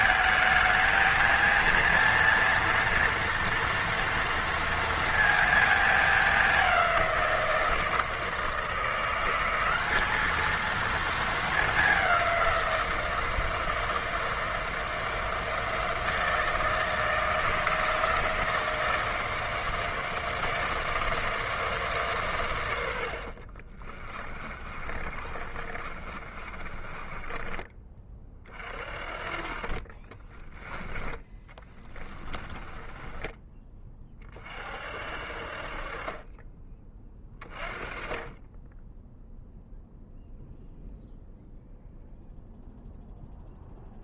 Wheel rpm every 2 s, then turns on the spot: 220, 230, 230, 200, 160, 220, 180, 160, 160, 160, 160, 110, 30, 30, 40, 10, 20, 50, 20, 20, 0, 0.
24-28 32-34